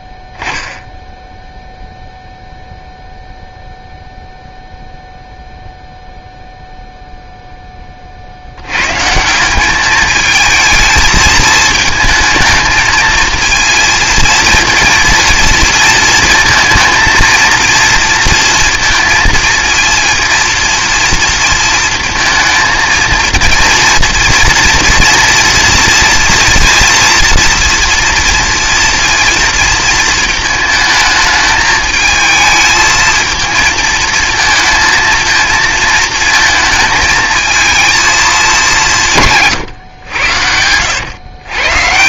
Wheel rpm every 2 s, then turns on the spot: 0, 0, 0, 0, 90, 220, 220, 230, 230, 230, 230, 230, 230, 230, 230, 220, 220, 220, 220, 190, 90.
none